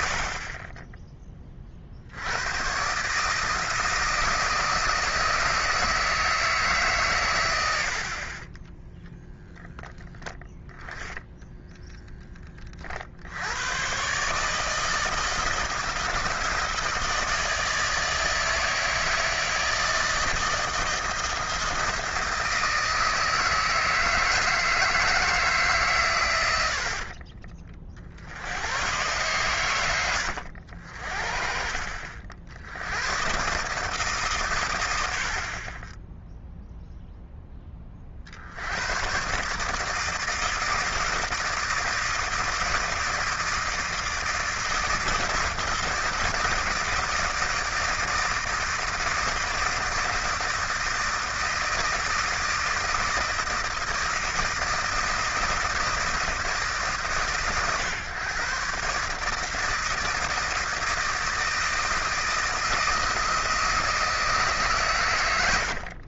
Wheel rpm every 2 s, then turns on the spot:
10, 130, 160, 140, 10, 0, 40, 160, 160, 160, 160, 160, 160, 70, 110, 70, 90, 90, 0, 100, 160, 160, 160, 160, 160, 160, 160, 160, 150, 140, 160, 160, 140.
8-10